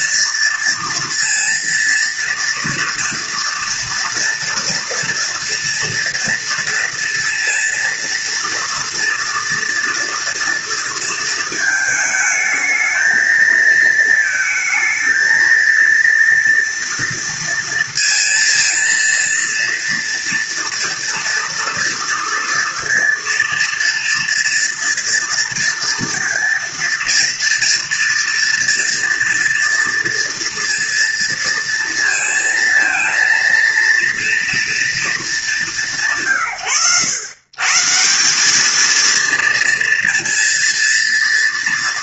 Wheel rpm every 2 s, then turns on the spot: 230, 230, 230, 230, 240, 230, 220, 220, 230, 230, 230, 230, 230, 230, 240, 230, 230, 230, 120, 220, 230.
none